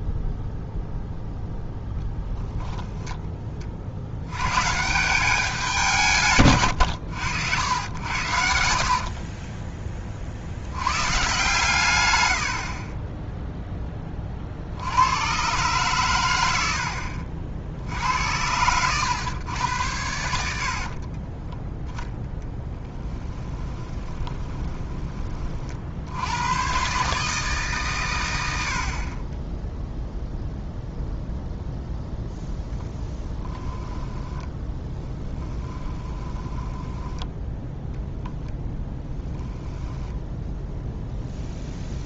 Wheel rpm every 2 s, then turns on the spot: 0, 0, 130, 120, 70, 90, 40, 60, 80, 100, 70, 10, 20, 120, 60, 0, 0, 10, 10, 0, 0.
8-10 12-14 20-26 34-38